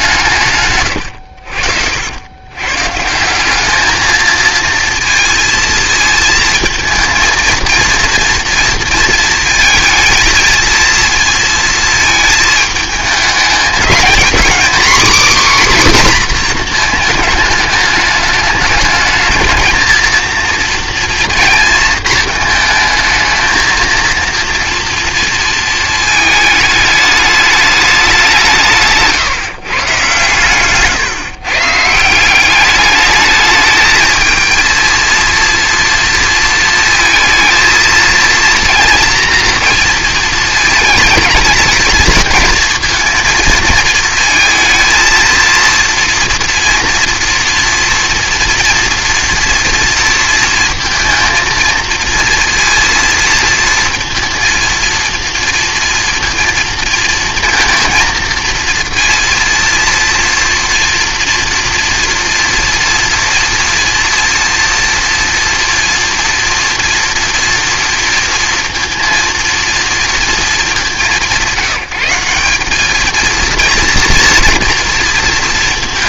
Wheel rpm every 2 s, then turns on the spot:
120, 120, 230, 230, 230, 230, 220, 250, 240, 220, 230, 220, 230, 210, 160, 140, 200, 230, 230, 230, 220, 220, 220, 230, 230, 230, 230, 230, 230, 230, 230, 230, 240, 230, 230, 210, 200, 230.
none